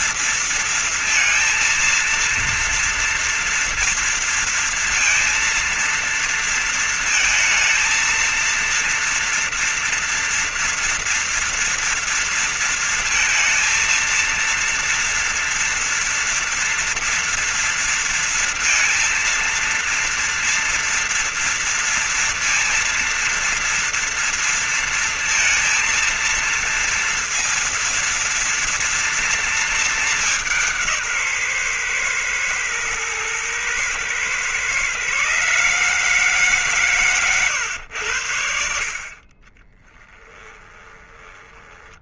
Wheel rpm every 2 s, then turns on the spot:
230, 230, 230, 230, 230, 230, 230, 230, 240, 230, 230, 230, 230, 230, 230, 200, 120, 120, 140, 80, 20.
40-42